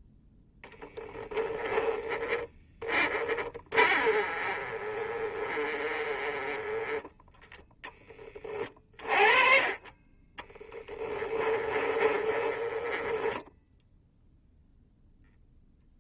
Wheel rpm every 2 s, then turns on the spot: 0, 20, 30, 20, 30, 20, 20, 0.
2-8 10-14